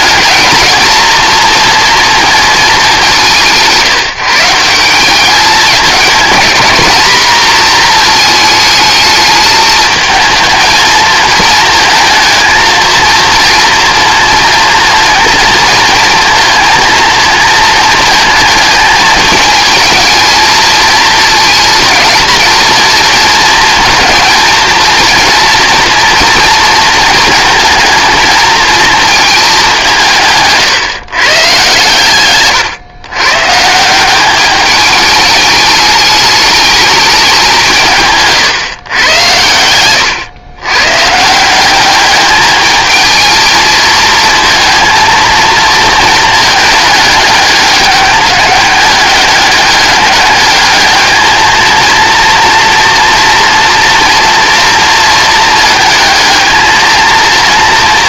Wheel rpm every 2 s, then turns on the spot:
230, 210, 180, 210, 220, 220, 230, 230, 230, 220, 220, 230, 230, 220, 230, 150, 130, 210, 210, 120, 120, 220, 230, 210, 200, 210, 230, 230, 220.
none